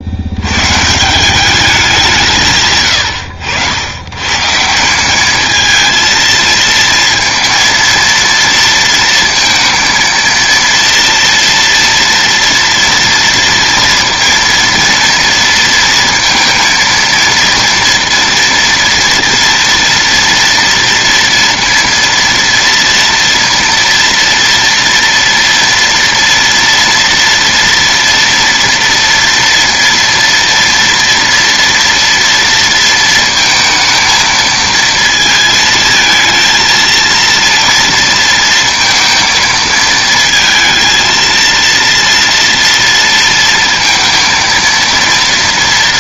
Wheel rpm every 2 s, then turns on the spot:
80, 160, 120, 230, 230, 230, 230, 230, 230, 230, 230, 230, 230, 230, 230, 230, 230, 230, 220, 230, 230, 230, 230.
none